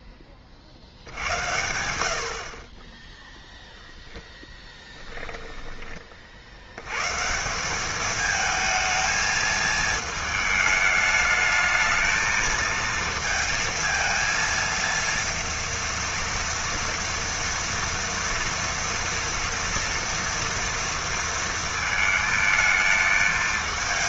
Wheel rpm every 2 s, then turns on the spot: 40, 30, 10, 120, 220, 220, 230, 230, 240, 230, 230, 220.
4-6